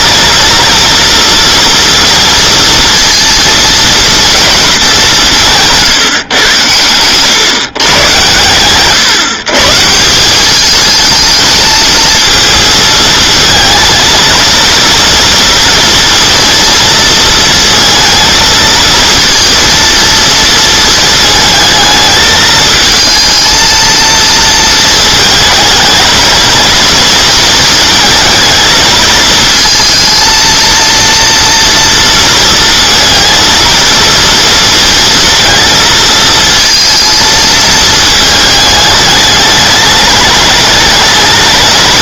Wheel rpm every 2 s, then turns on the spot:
240, 230, 220, 120, 120, 200, 230, 230, 230, 230, 220, 220, 230, 230, 220, 230, 230, 230, 230, 210, 210.
none